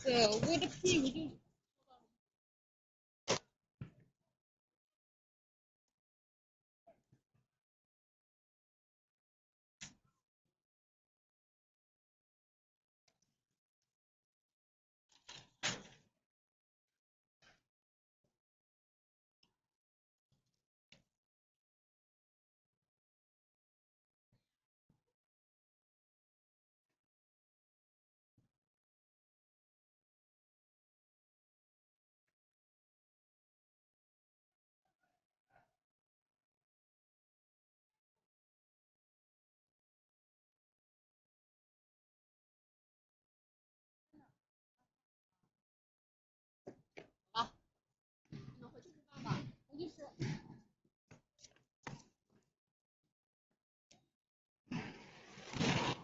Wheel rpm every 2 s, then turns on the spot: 0, 0, 0, 0, 0, 0, 0, 0, 0, 0, 0, 0, 0, 0, 0, 0, 0, 0, 0, 0, 0, 0, 0, 0, 0, 0, 0, 0.
none